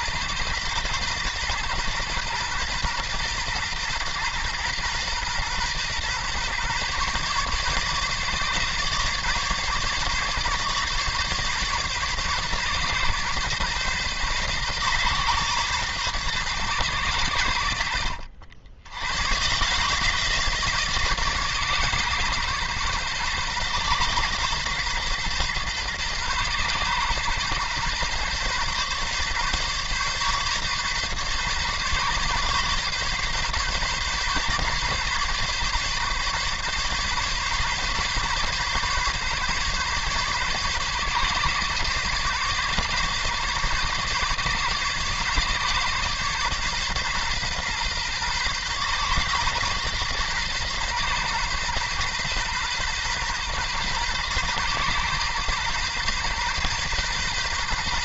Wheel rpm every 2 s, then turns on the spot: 120, 120, 120, 130, 140, 140, 130, 130, 120, 70, 150, 130, 130, 130, 130, 140, 140, 140, 140, 140, 140, 140, 140, 130, 130, 130, 130, 120, 130.
none